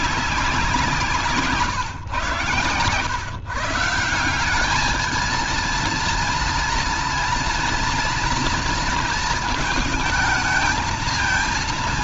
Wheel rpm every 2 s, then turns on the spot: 190, 120, 190, 230, 230, 220.
none